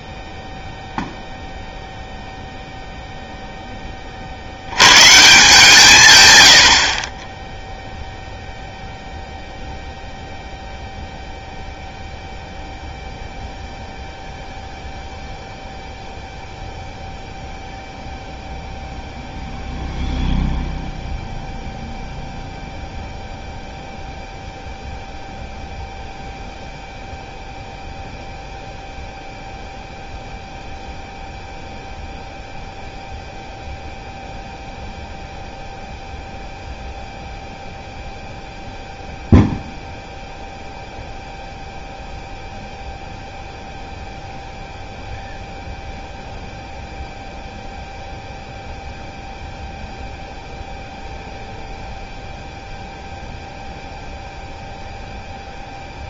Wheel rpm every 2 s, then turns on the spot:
0, 0, 80, 90, 0, 0, 0, 0, 0, 0, 0, 0, 0, 0, 0, 0, 0, 0, 0, 0, 0, 0, 0, 0, 0, 0, 0, 0.
none